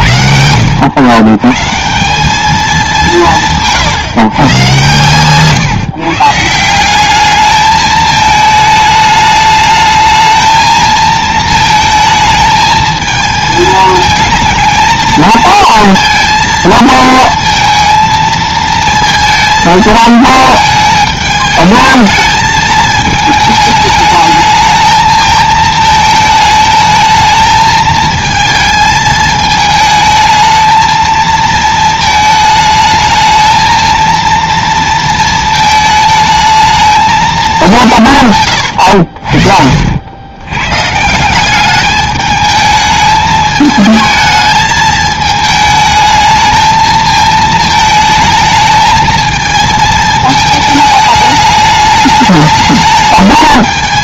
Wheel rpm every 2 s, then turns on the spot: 90, 200, 130, 180, 210, 220, 220, 220, 230, 220, 210, 220, 220, 220, 220, 220, 220, 230, 220, 100, 150, 220, 220, 220, 220, 220, 220.
38-40